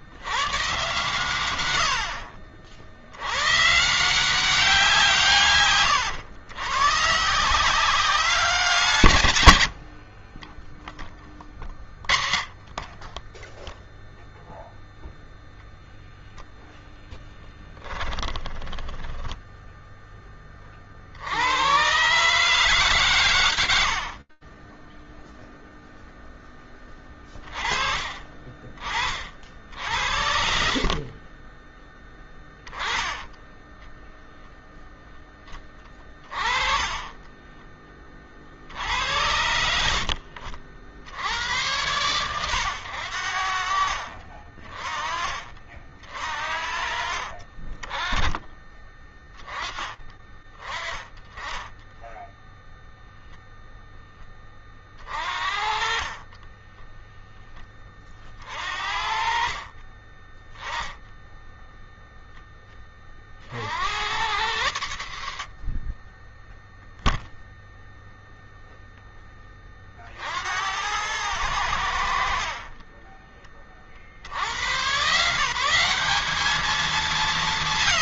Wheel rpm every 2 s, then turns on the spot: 110, 120, 130, 170, 90, 20, 0, 0, 10, 10, 90, 90, 0, 40, 50, 10, 10, 10, 10, 80, 90, 80, 40, 40, 20, 20, 0, 30, 0, 50, 10, 20, 70, 0, 0, 90, 20, 150, 190.
8-10 32-34 72-74